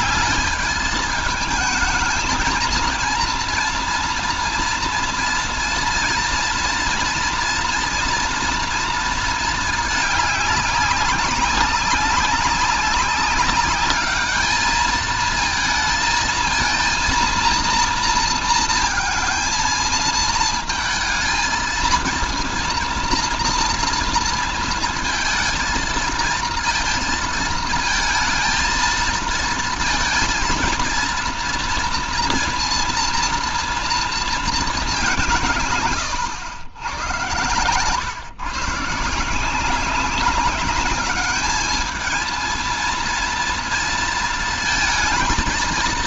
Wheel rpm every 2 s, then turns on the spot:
210, 230, 230, 230, 230, 200, 200, 220, 230, 220, 220, 230, 230, 220, 230, 230, 230, 200, 100, 150, 200, 230, 230.
none